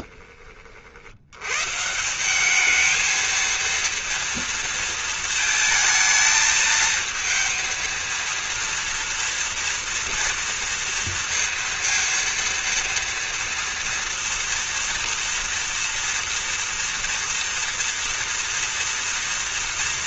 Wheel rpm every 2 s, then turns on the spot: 20, 180, 230, 220, 230, 230, 230, 230, 230, 230.
none